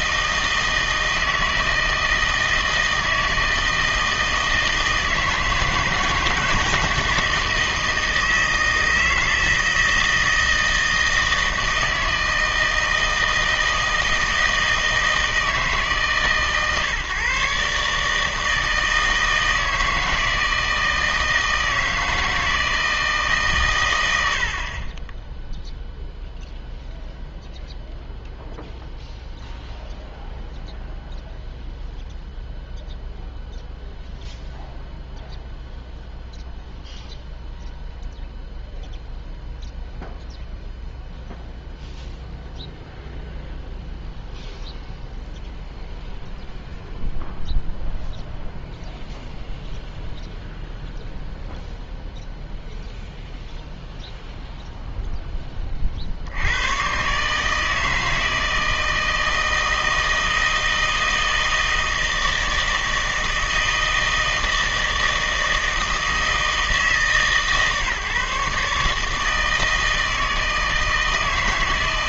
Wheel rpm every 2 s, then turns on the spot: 160, 160, 160, 160, 160, 160, 160, 160, 140, 160, 160, 160, 50, 0, 0, 0, 0, 0, 0, 0, 0, 0, 0, 0, 0, 0, 0, 0, 100, 160, 160, 160, 160, 160, 150, 160.
none